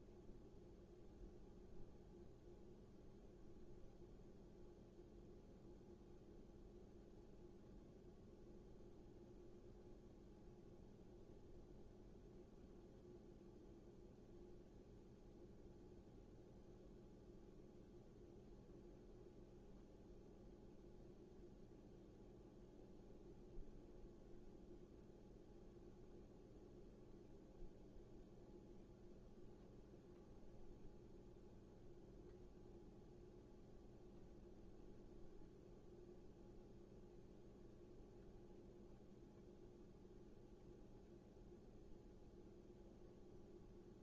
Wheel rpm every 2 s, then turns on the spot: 0, 0, 0, 0, 0, 0, 0, 0, 0, 0, 0, 0, 0, 0, 0, 0, 0, 0, 0, 0, 0, 0.
none